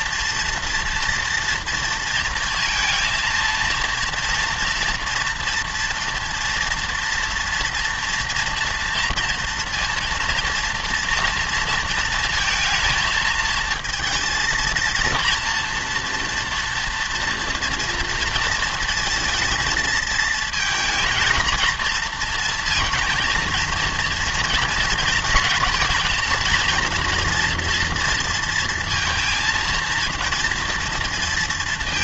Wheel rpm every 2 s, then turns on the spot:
230, 230, 240, 230, 230, 230, 230, 230, 230, 230, 230, 230, 230, 230, 230, 230.
none